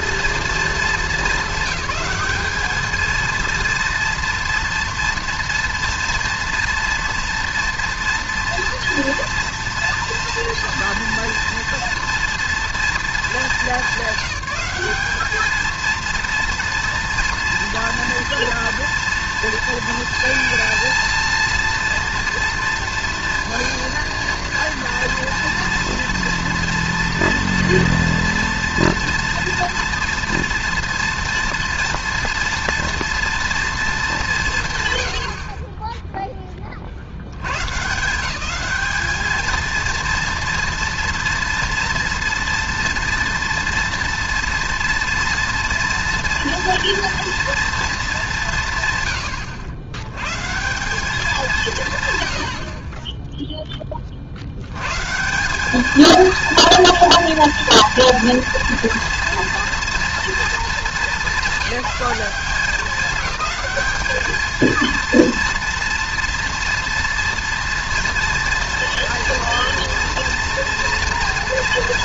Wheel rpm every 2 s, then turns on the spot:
230, 220, 230, 240, 230, 230, 240, 190, 230, 230, 230, 230, 230, 240, 240, 230, 230, 170, 10, 190, 230, 230, 230, 230, 170, 150, 70, 80, 230, 230, 230, 200, 230, 230, 230, 240.
none